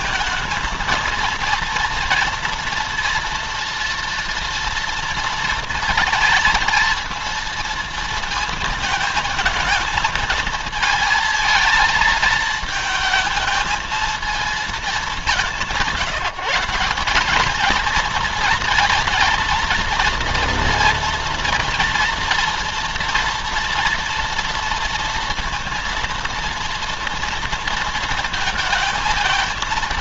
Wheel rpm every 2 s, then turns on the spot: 230, 230, 230, 230, 220, 220, 220, 210, 190, 230, 240, 240, 230, 230, 220.
none